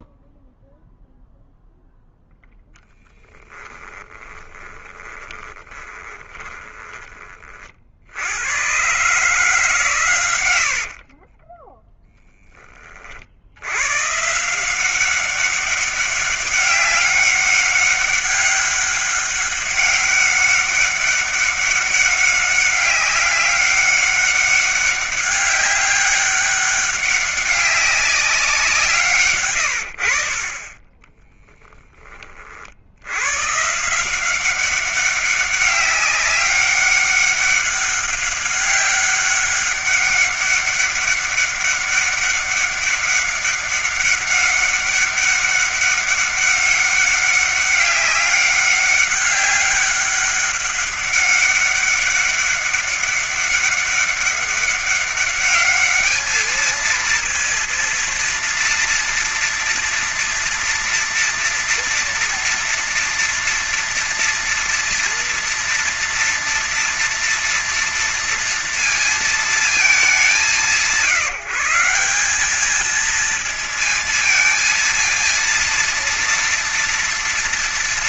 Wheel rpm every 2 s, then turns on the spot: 0, 0, 10, 30, 110, 60, 20, 170, 200, 200, 200, 200, 200, 200, 180, 30, 50, 190, 200, 200, 200, 200, 200, 200, 200, 200, 200, 200, 220, 230, 230, 230, 230, 230, 230, 160, 210, 230, 230.
4-6 10-12